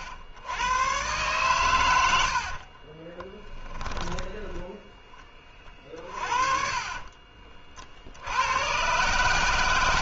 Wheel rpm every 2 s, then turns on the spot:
100, 60, 10, 40, 110.
2-8